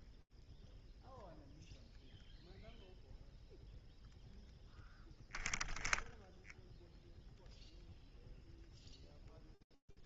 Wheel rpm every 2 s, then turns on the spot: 0, 0, 0, 0, 0.
none